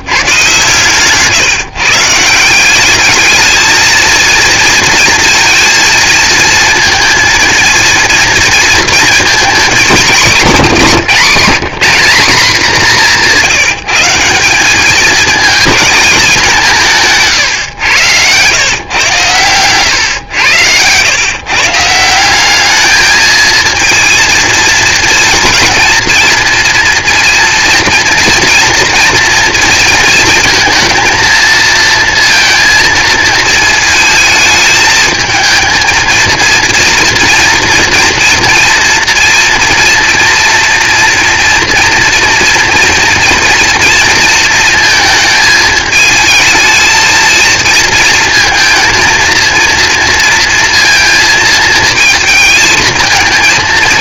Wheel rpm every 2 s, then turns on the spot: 140, 190, 230, 230, 230, 190, 190, 200, 190, 120, 110, 210, 220, 230, 240, 230, 230, 220, 230, 230, 240, 240, 230, 220, 230, 230, 220.
none